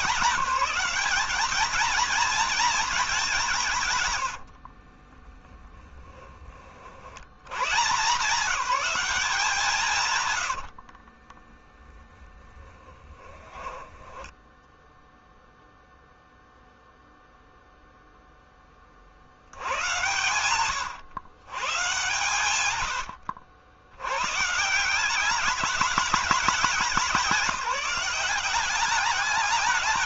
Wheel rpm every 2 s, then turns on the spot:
200, 220, 40, 60, 190, 60, 20, 0, 0, 40, 110, 90, 170, 190, 200.
4-6 10-14